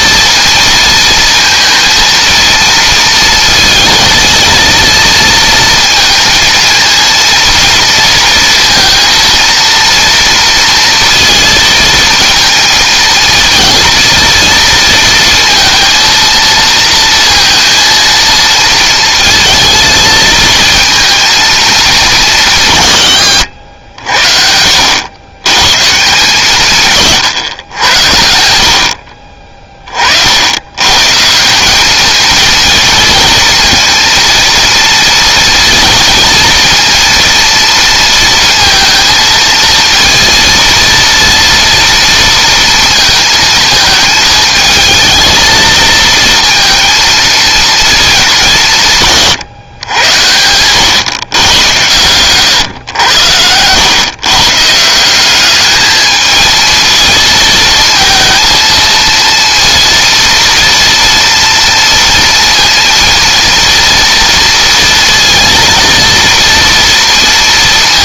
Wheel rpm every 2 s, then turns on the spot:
230, 230, 230, 230, 230, 230, 220, 230, 230, 230, 230, 150, 80, 150, 70, 130, 230, 230, 230, 230, 230, 230, 220, 230, 160, 120, 110, 160, 220, 230, 230, 230, 230, 230.
none